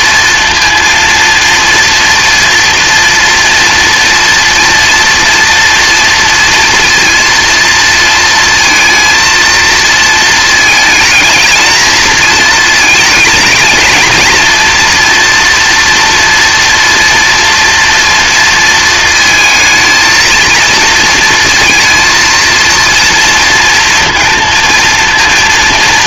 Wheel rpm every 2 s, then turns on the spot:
230, 230, 230, 230, 230, 220, 220, 230, 230, 220, 230, 230, 230.
none